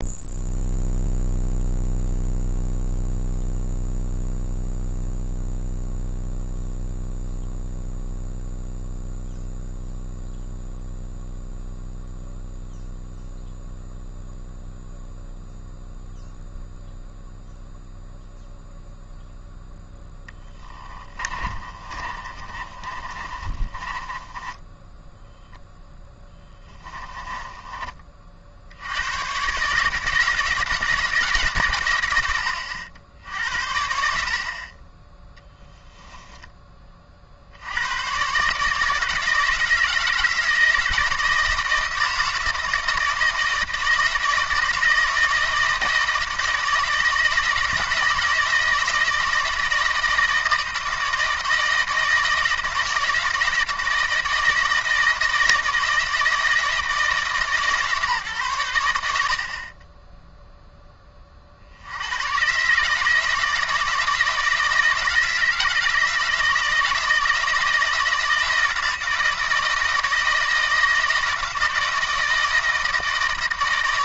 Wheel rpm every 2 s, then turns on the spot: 0, 0, 0, 0, 0, 0, 0, 0, 0, 0, 20, 30, 10, 20, 80, 160, 80, 40, 20, 160, 160, 160, 160, 170, 160, 160, 170, 160, 160, 120, 10, 140, 160, 160, 170, 160, 160.
20-28